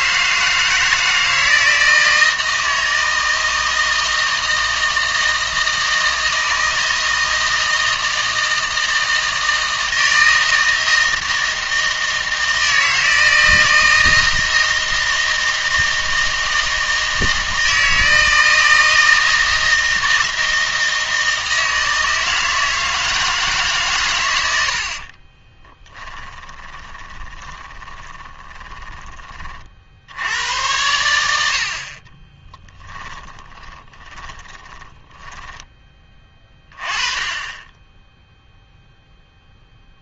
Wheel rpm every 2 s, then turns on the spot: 160, 160, 160, 160, 160, 160, 160, 160, 160, 160, 160, 160, 80, 20, 20, 100, 20, 30, 30, 0.
26-30 32-36